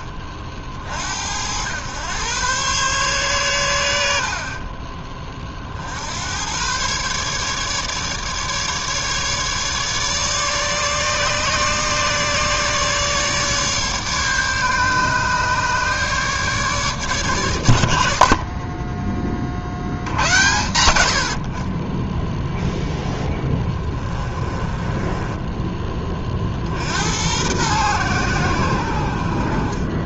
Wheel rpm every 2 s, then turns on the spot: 70, 130, 30, 130, 150, 150, 150, 150, 150, 30, 90, 10, 20, 70, 80.
24-26